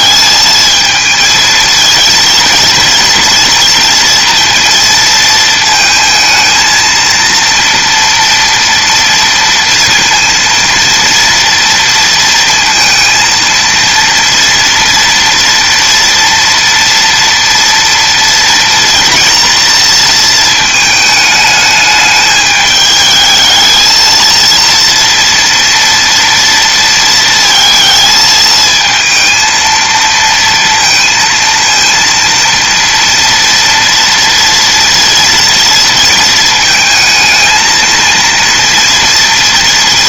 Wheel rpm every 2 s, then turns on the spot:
220, 230, 230, 230, 230, 230, 230, 240, 230, 240, 220, 220, 230, 230, 220, 230, 230, 230, 220, 240.
none